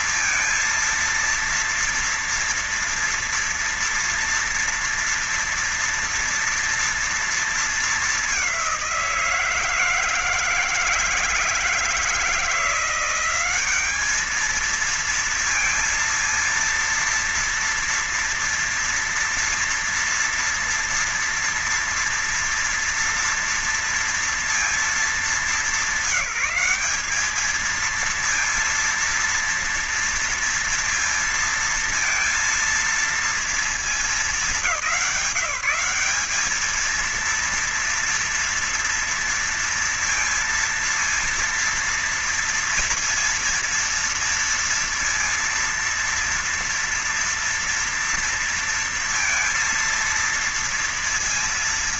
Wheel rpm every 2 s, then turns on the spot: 230, 230, 230, 230, 200, 160, 170, 210, 230, 230, 240, 230, 230, 190, 230, 230, 230, 210, 210, 230, 230, 230, 230, 230, 230, 230.
none